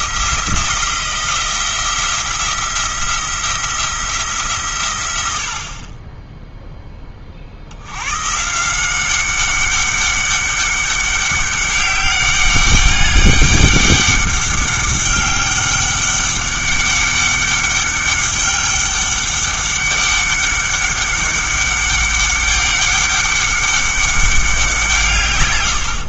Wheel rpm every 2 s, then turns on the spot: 170, 170, 130, 10, 160, 200, 200, 200, 200, 200, 200, 200, 180.
none